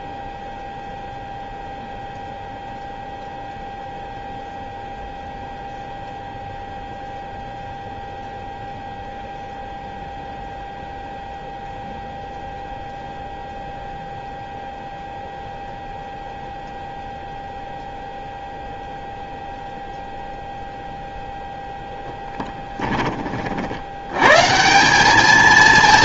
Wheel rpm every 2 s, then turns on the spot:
0, 0, 0, 0, 0, 0, 0, 0, 0, 0, 0, 10, 160.
22-24